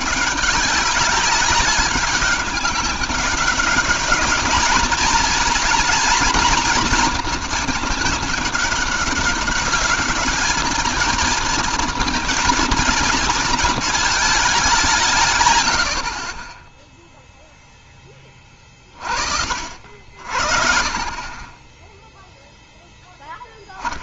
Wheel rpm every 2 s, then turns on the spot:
200, 200, 210, 240, 200, 210, 230, 190, 10, 30, 60, 0.
none